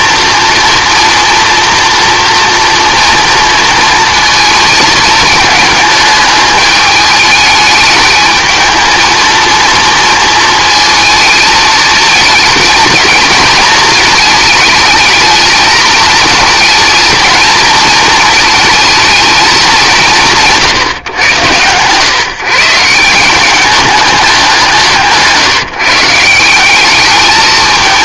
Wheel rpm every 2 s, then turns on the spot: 230, 240, 230, 220, 220, 220, 220, 210, 220, 230, 150, 150, 180, 180.
none